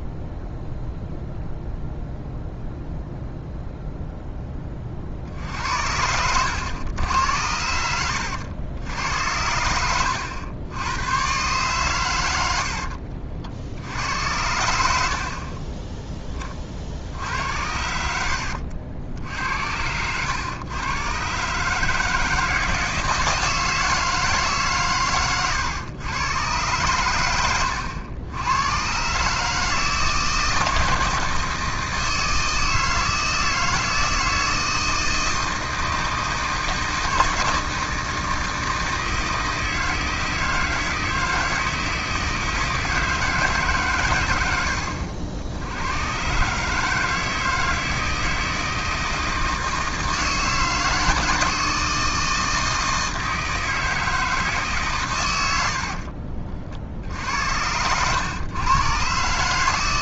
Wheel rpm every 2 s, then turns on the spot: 0, 0, 20, 100, 80, 100, 70, 70, 30, 90, 110, 160, 140, 110, 100, 160, 160, 160, 160, 160, 160, 160, 100, 140, 160, 160, 160, 150, 60, 110.
12-14